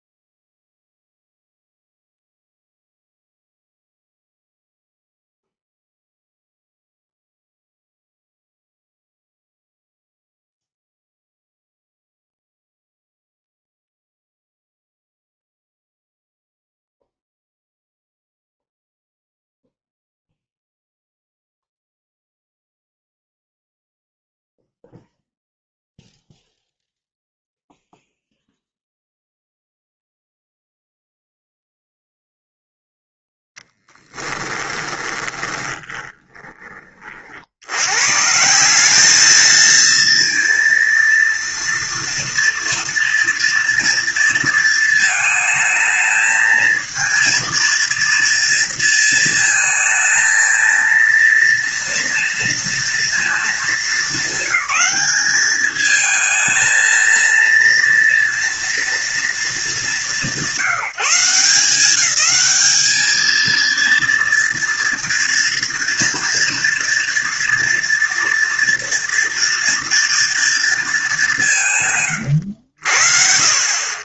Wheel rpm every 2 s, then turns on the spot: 0, 0, 0, 0, 0, 0, 0, 0, 0, 0, 0, 0, 0, 0, 0, 0, 0, 20, 40, 200, 230, 230, 220, 230, 230, 230, 230, 200, 230, 230, 180, 220, 230, 230, 240, 210, 60.
34-36